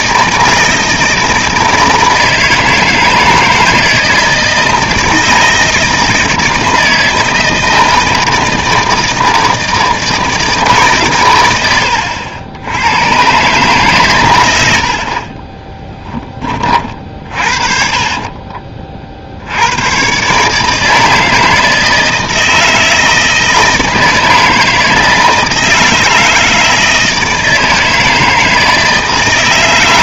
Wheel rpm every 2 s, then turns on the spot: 160, 160, 160, 160, 160, 160, 90, 80, 30, 40, 150, 160, 160, 160, 160.
14-16